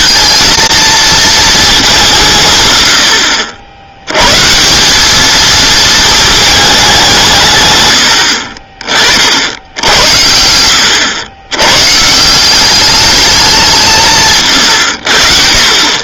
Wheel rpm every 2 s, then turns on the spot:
230, 120, 170, 200, 40, 90, 190, 120.
none